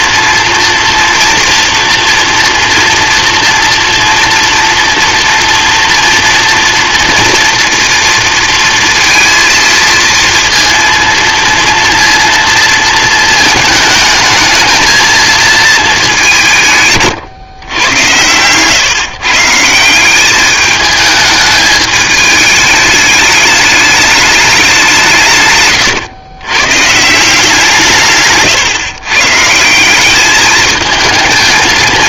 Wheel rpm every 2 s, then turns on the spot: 230, 230, 230, 230, 230, 230, 230, 220, 160, 120, 210, 210, 200, 120, 130, 220.
none